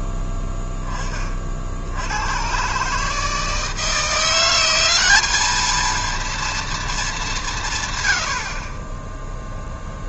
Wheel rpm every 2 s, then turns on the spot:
20, 140, 180, 220, 10.
none